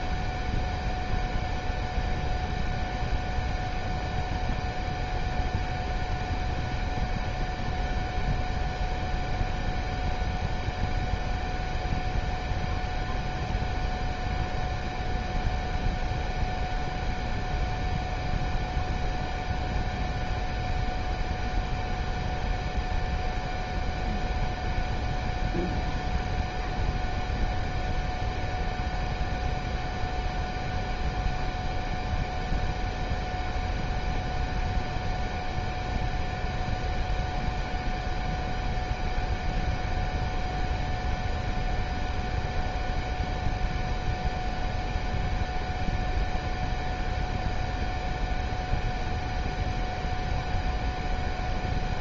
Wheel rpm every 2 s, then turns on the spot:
0, 0, 0, 0, 0, 0, 0, 0, 0, 0, 0, 0, 0, 0, 0, 0, 0, 0, 0, 0, 0, 0, 0, 0, 0, 0.
none